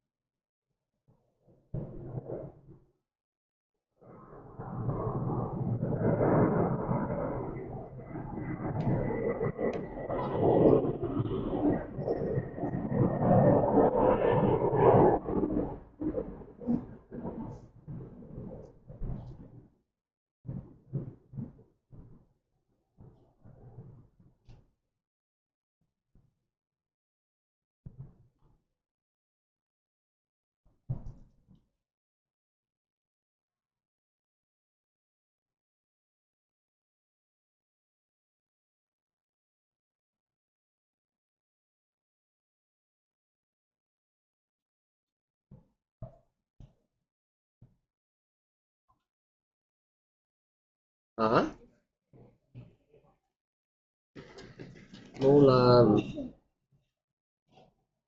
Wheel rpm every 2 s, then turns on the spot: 0, 0, 0, 0, 0, 0, 0, 0, 0, 0, 0, 0, 0, 0, 0, 0, 0, 0, 0, 0, 0, 0, 0, 0, 0, 0, 0, 0, 0.
none